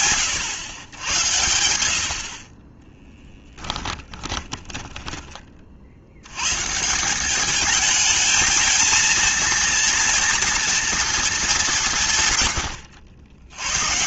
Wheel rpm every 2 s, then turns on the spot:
100, 10, 10, 150, 220, 230, 80.
4-6